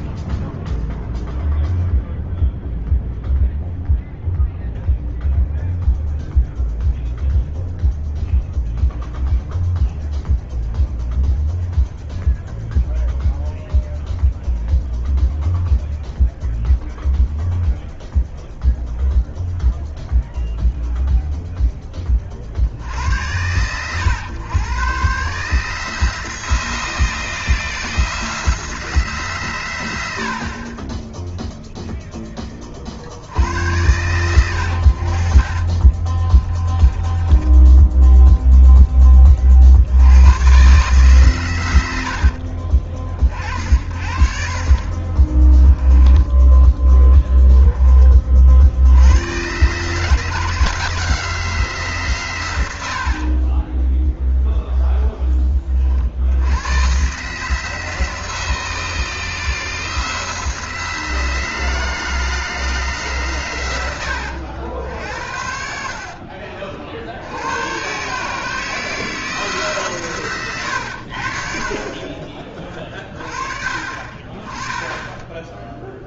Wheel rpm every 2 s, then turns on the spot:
0, 0, 0, 0, 0, 0, 0, 0, 0, 0, 0, 70, 120, 160, 160, 30, 40, 80, 20, 10, 130, 40, 30, 10, 80, 160, 80, 0, 110, 160, 160, 160, 80, 60, 150, 90, 30, 10.
36-38 44-48